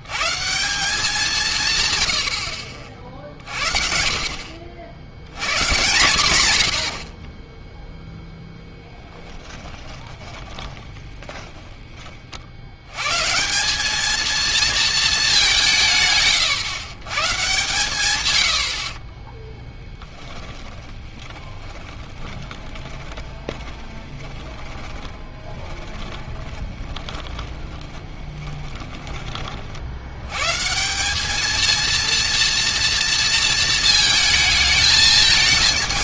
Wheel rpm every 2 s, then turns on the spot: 170, 50, 60, 110, 0, 20, 80, 220, 120, 80, 20, 20, 20, 20, 20, 140, 230, 220.
10-12 20-30